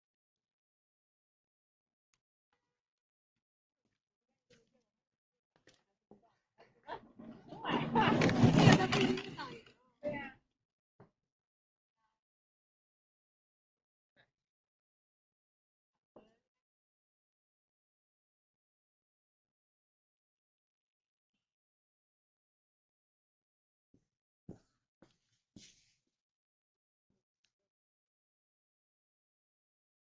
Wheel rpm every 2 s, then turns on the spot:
0, 0, 0, 0, 0, 0, 0, 0, 0, 0, 0, 0, 0, 0, 0.
none